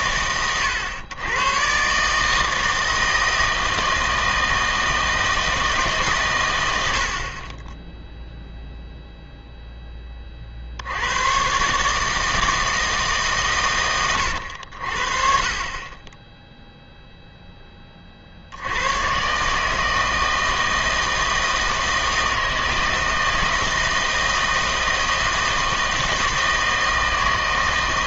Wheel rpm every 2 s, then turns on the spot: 110, 160, 160, 90, 0, 60, 160, 70, 0, 90, 160, 160, 160, 160.
none